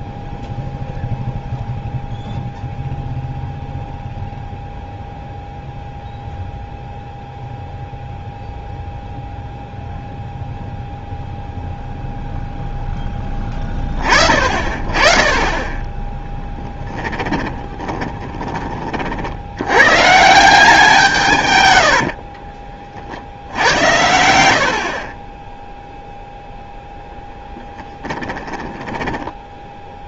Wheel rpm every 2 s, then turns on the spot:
0, 0, 0, 0, 0, 0, 0, 30, 10, 20, 170, 30, 60, 0, 10.
16-18 22-24 28-30